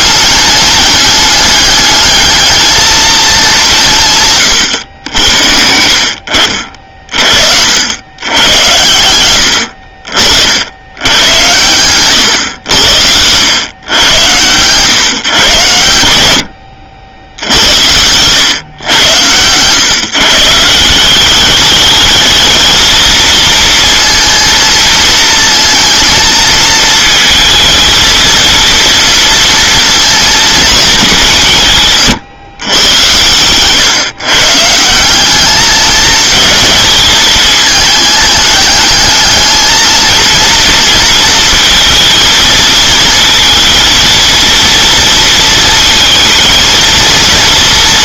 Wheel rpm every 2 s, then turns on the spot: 200, 220, 100, 50, 90, 100, 80, 130, 70, 120, 170, 220, 230, 220, 230, 220, 100, 170, 220, 210, 230, 230, 230, 230.
none